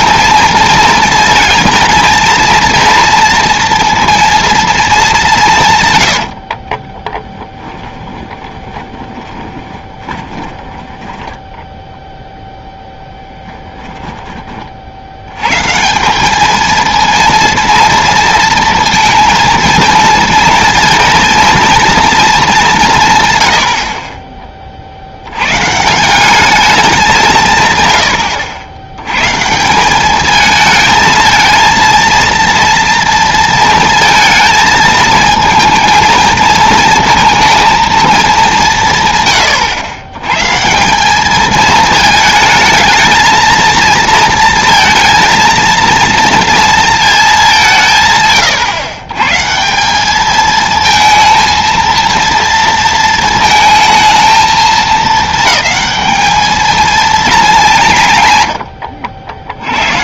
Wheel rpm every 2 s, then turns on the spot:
230, 230, 230, 50, 20, 10, 0, 30, 220, 230, 230, 200, 40, 200, 80, 220, 230, 220, 220, 190, 140, 220, 230, 230, 120, 220, 230, 220, 220, 100.
6-12